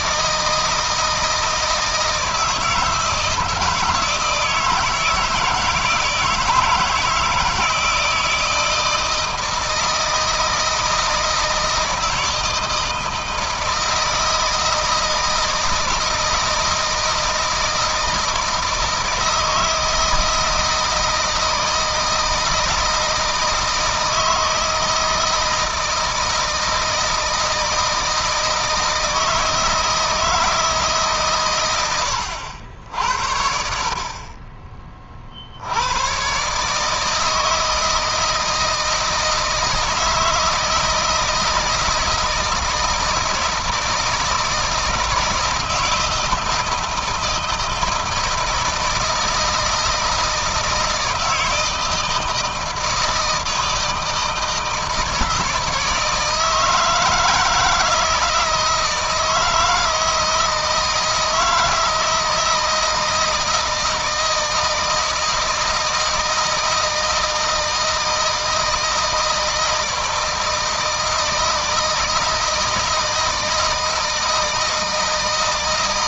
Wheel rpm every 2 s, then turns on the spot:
160, 160, 160, 160, 160, 160, 160, 160, 160, 160, 160, 160, 160, 160, 160, 160, 80, 30, 150, 160, 160, 160, 160, 160, 160, 160, 160, 160, 160, 160, 160, 160, 160, 160, 160, 160, 160, 160.
none